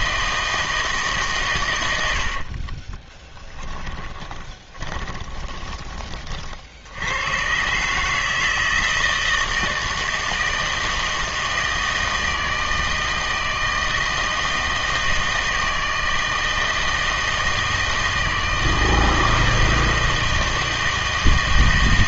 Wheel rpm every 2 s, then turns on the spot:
160, 40, 10, 70, 160, 160, 160, 160, 160, 160, 160.
2-6